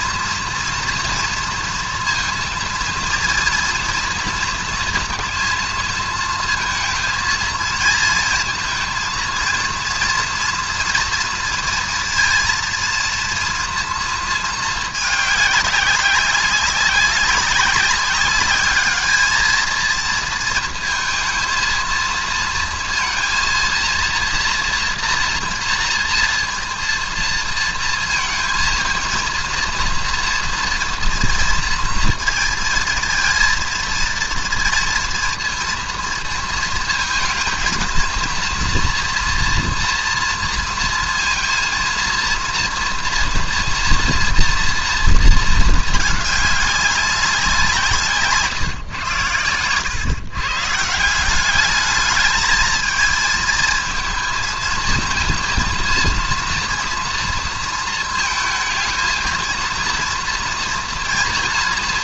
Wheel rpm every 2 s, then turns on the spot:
230, 230, 230, 230, 230, 230, 230, 220, 190, 210, 220, 230, 230, 230, 230, 230, 230, 230, 230, 230, 230, 230, 230, 200, 140, 140, 220, 220, 230, 230, 240.
none